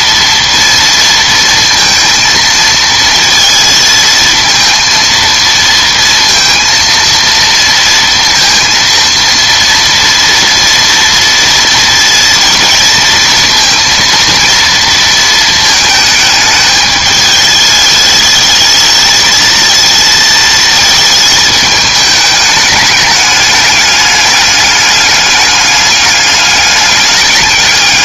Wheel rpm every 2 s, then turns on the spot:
230, 230, 230, 230, 230, 230, 230, 230, 210, 220, 220, 210, 210, 200.
none